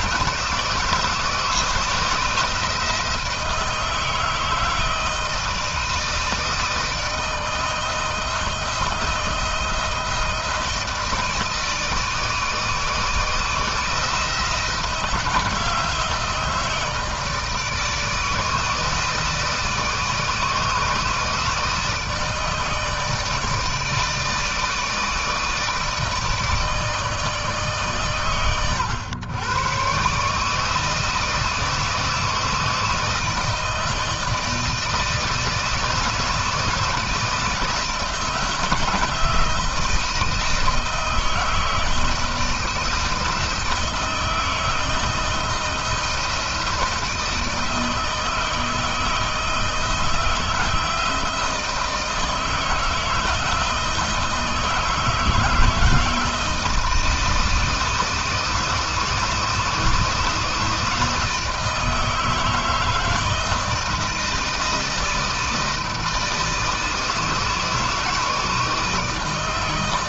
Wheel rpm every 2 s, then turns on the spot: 160, 160, 160, 160, 160, 160, 160, 160, 160, 160, 160, 160, 160, 160, 110, 150, 160, 160, 170, 160, 160, 160, 160, 160, 160, 170, 160, 160, 160, 160, 160, 160, 160, 160, 160.
none